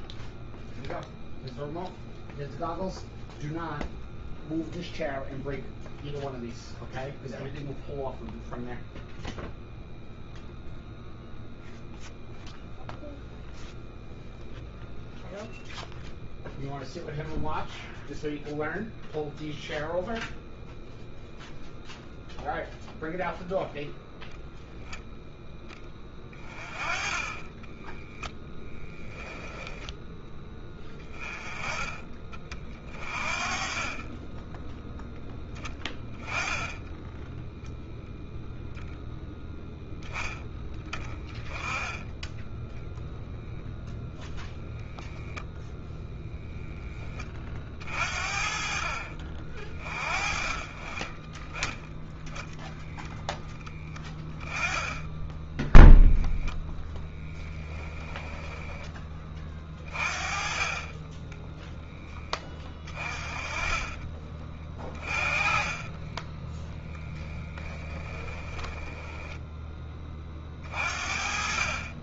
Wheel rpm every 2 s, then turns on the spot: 0, 0, 0, 0, 0, 0, 0, 0, 0, 0, 0, 0, 0, 20, 0, 10, 30, 10, 10, 0, 10, 10, 0, 20, 50, 20, 0, 10, 10, 10, 20, 20, 30, 0, 10, 40.
26-28 56-58 68-70